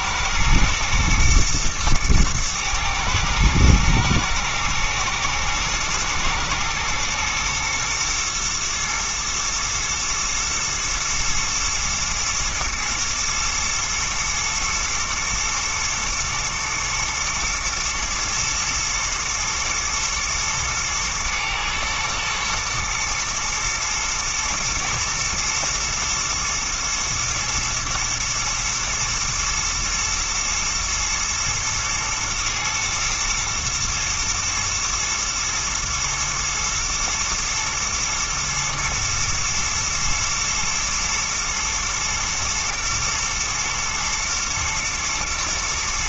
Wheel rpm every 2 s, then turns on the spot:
110, 110, 110, 120, 120, 110, 120, 120, 110, 120, 110, 120, 120, 110, 110, 110, 120, 110, 110, 120, 120, 110, 120.
none